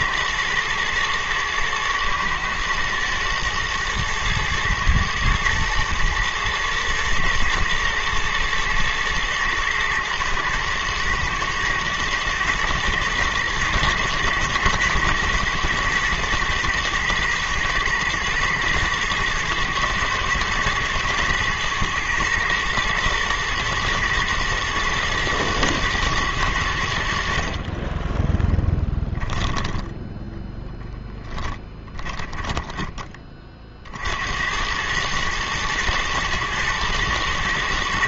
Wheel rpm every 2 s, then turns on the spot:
120, 120, 110, 110, 110, 120, 110, 110, 110, 110, 110, 120, 110, 80, 10, 0, 20, 110, 110.
none